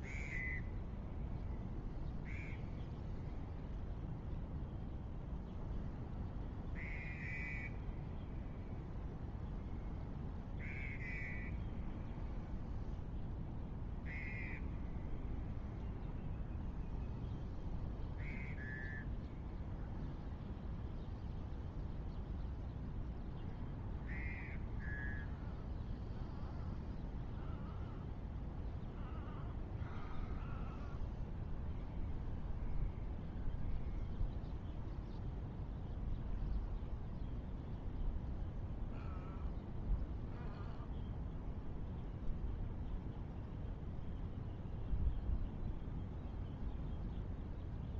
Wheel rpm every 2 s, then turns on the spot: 0, 0, 0, 0, 0, 0, 0, 0, 0, 0, 0, 0, 0, 0, 0, 0, 0, 0, 0, 0, 0, 0, 0, 0.
none